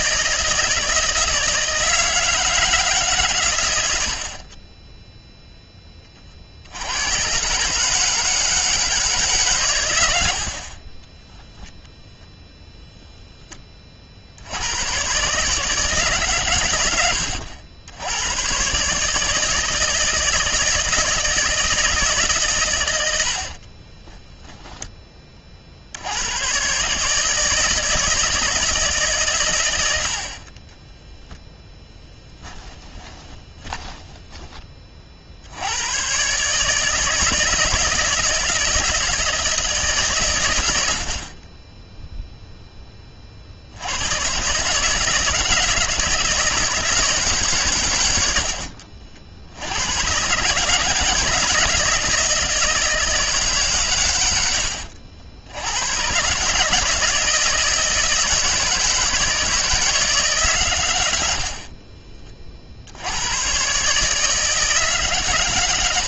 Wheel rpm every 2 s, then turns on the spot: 160, 150, 10, 100, 150, 20, 0, 120, 100, 150, 160, 80, 30, 150, 150, 20, 20, 30, 160, 160, 70, 30, 150, 160, 60, 160, 160, 70, 160, 160, 90, 100, 140.
10-12 30-34